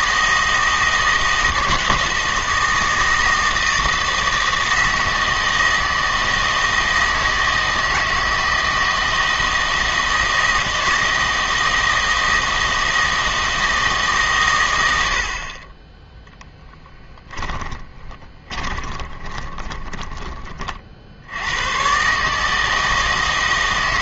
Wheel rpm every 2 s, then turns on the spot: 160, 160, 160, 160, 160, 160, 160, 100, 20, 30, 50, 160.
16-20